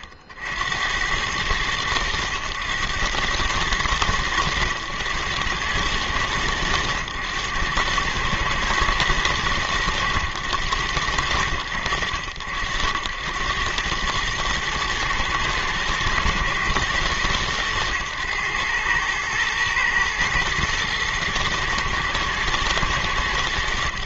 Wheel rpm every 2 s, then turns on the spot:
60, 100, 100, 100, 120, 110, 70, 110, 110, 110, 110, 110.
none